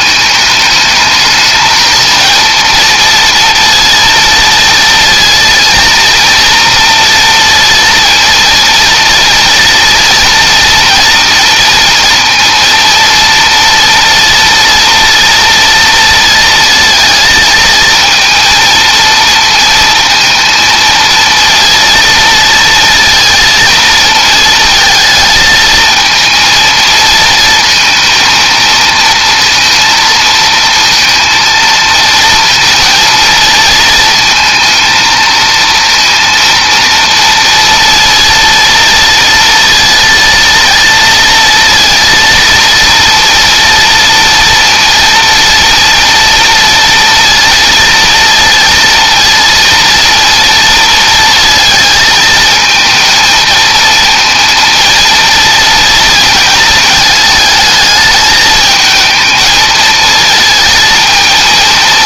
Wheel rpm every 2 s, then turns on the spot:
210, 230, 230, 230, 230, 230, 230, 230, 230, 230, 230, 230, 220, 220, 230, 230, 230, 220, 230, 230, 230, 230, 230, 230, 230, 230, 220, 230, 220, 220, 230.
none